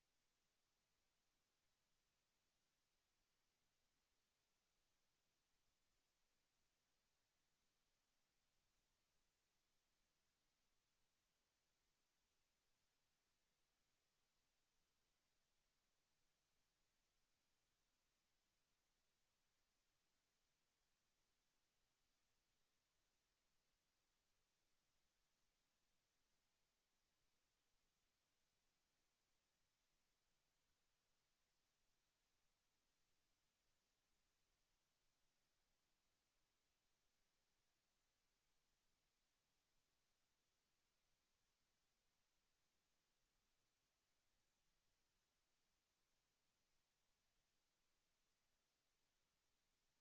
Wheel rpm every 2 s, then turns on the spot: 0, 0, 0, 0, 0, 0, 0, 0, 0, 0, 0, 0, 0, 0, 0, 0, 0, 0, 0, 0, 0, 0, 0, 0, 0.
none